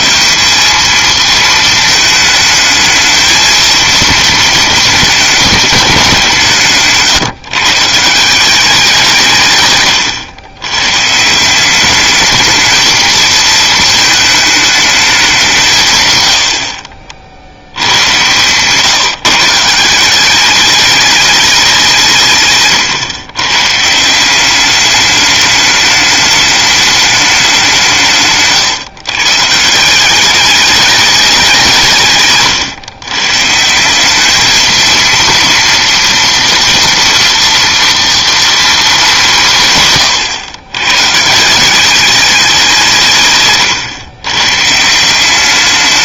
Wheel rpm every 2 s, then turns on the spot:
210, 220, 210, 150, 190, 110, 220, 220, 70, 140, 200, 130, 200, 210, 140, 210, 130, 220, 230, 230, 120, 180, 130.
28-30